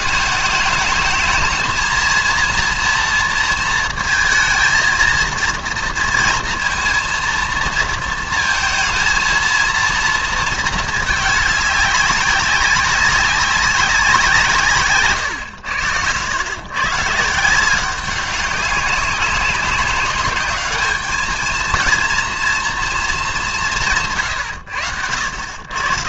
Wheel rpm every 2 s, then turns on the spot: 210, 230, 220, 230, 220, 220, 190, 140, 120, 200, 210, 230, 100.
none